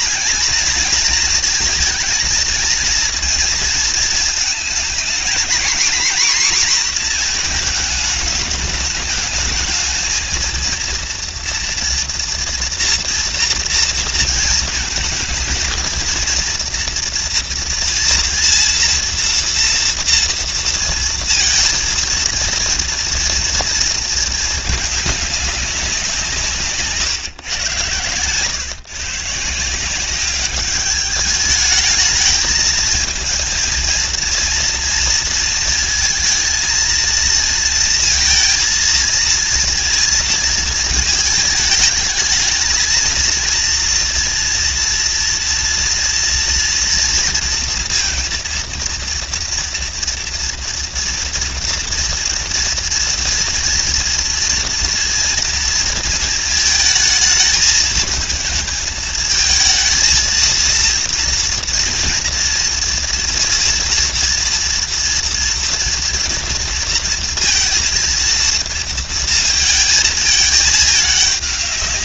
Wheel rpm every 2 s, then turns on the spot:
220, 230, 230, 230, 210, 230, 230, 230, 230, 230, 230, 230, 210, 140, 140, 210, 220, 230, 230, 230, 220, 220, 230, 230, 230, 230, 230, 230, 220, 220, 230, 230, 240, 230, 230, 210.
none